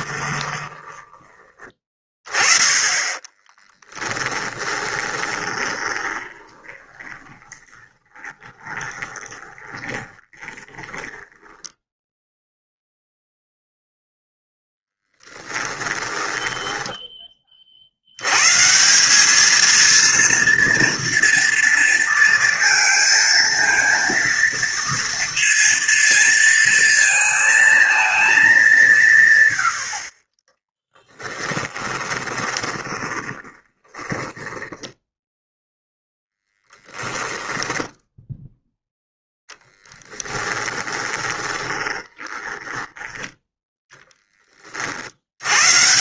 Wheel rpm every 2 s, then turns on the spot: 10, 20, 20, 20, 20, 20, 0, 10, 10, 180, 230, 230, 230, 230, 170, 10, 30, 10, 0, 0, 20, 10, 50.
2-12 14-16 30-36 40-44